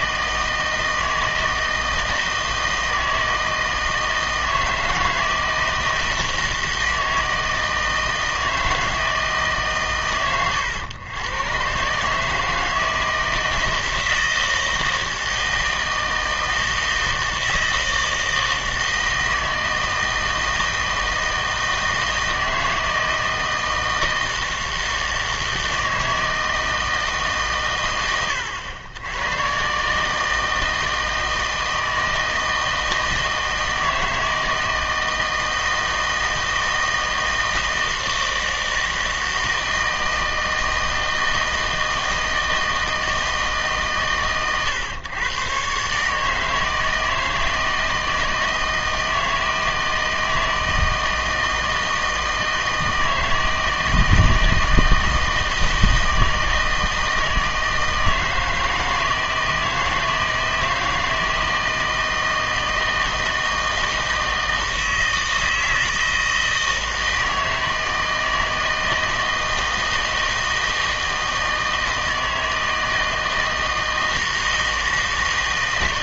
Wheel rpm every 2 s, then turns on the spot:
160, 160, 160, 160, 160, 100, 160, 160, 160, 160, 160, 160, 160, 160, 100, 160, 160, 160, 160, 160, 160, 160, 120, 160, 160, 160, 160, 160, 160, 160, 160, 160, 160, 160, 160, 160, 160, 160.
none